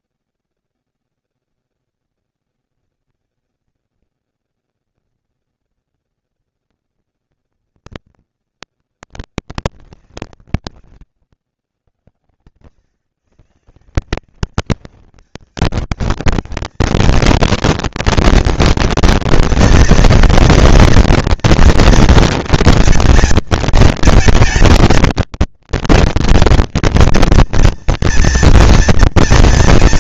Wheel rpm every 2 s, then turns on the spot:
230, 230, 230, 230, 220, 190, 110, 190, 220, 230, 230, 230, 220, 240, 240.
none